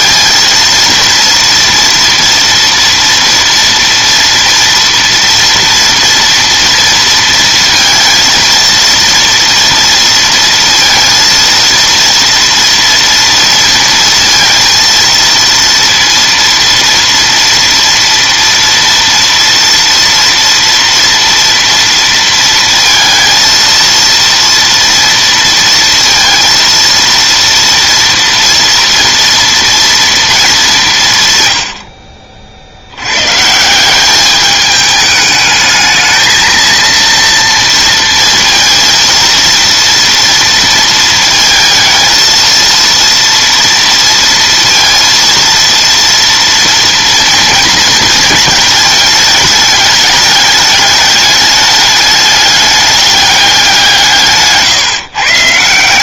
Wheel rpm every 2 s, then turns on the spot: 230, 230, 230, 230, 230, 230, 230, 230, 230, 230, 230, 230, 230, 230, 230, 200, 60, 210, 220, 230, 230, 230, 230, 230, 220, 210, 200, 150.
54-56